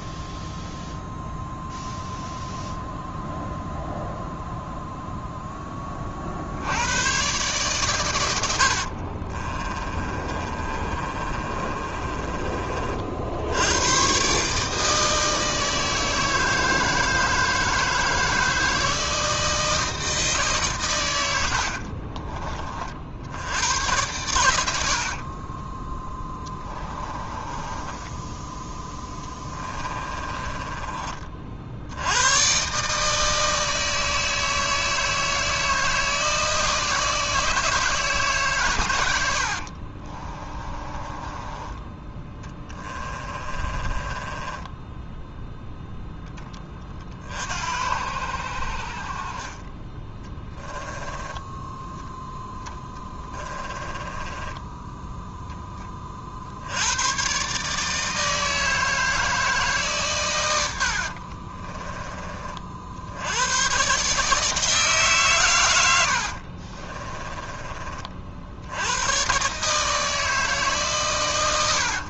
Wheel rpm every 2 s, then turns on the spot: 0, 0, 0, 70, 80, 30, 40, 150, 160, 160, 140, 40, 80, 20, 10, 20, 130, 160, 160, 120, 20, 20, 10, 20, 70, 10, 10, 10, 80, 160, 90, 40, 160, 50, 80, 150.
8-12 26-28 30-32 40-46 52-56 66-68